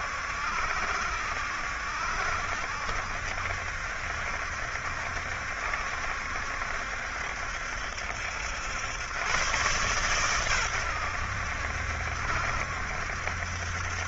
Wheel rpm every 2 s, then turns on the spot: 70, 70, 70, 70, 90, 100, 70.
none